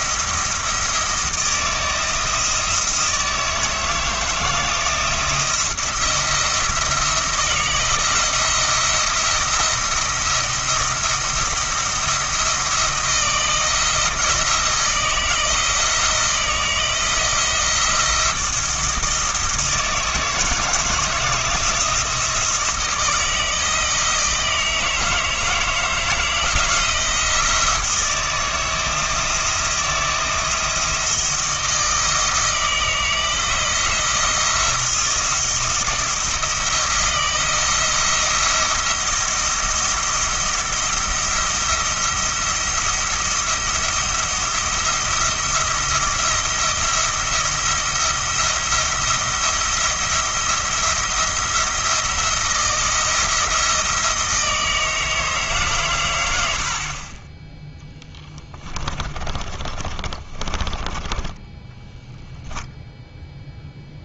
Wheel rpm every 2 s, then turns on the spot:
170, 160, 160, 160, 170, 170, 170, 170, 170, 160, 160, 160, 160, 170, 160, 160, 160, 170, 170, 170, 170, 170, 170, 170, 170, 170, 170, 160, 50, 20, 20, 0.
58-62